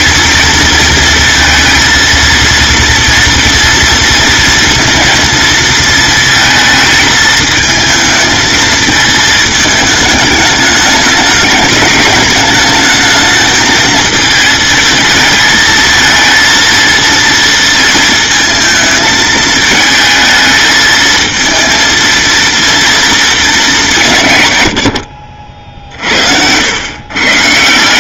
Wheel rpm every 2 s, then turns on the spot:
230, 230, 230, 220, 220, 210, 220, 220, 230, 220, 220, 230, 80, 110.
none